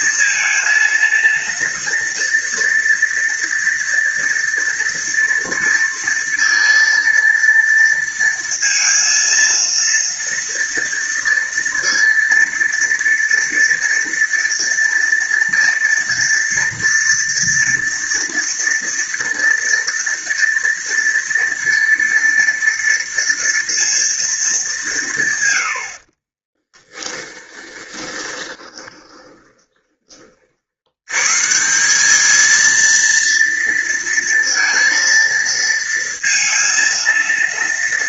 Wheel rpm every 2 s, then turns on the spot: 230, 230, 230, 230, 230, 230, 230, 230, 230, 230, 230, 230, 210, 20, 20, 70, 230, 230, 230.
26-30